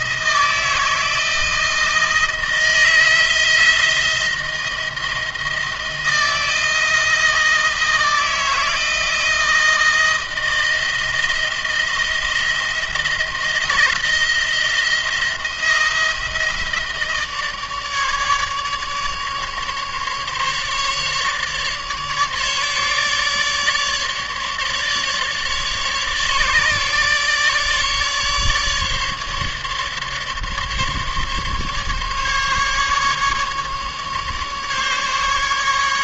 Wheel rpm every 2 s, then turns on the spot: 160, 160, 170, 160, 160, 160, 170, 170, 160, 150, 150, 150, 150, 150, 150, 150, 150, 140.
none